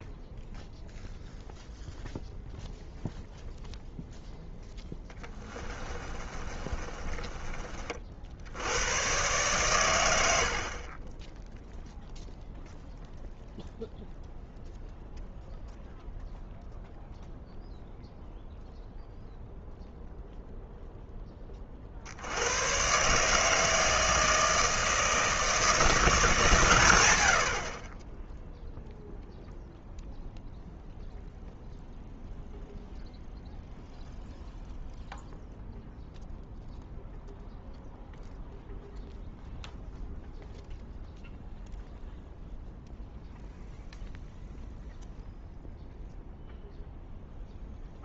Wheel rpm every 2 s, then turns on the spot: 0, 0, 10, 30, 100, 30, 0, 0, 0, 0, 0, 130, 160, 130, 0, 0, 0, 0, 0, 0, 0, 0, 0, 0.
4-8